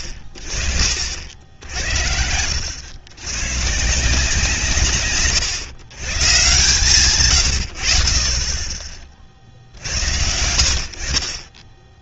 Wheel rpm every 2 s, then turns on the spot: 40, 90, 130, 160, 10, 80.
none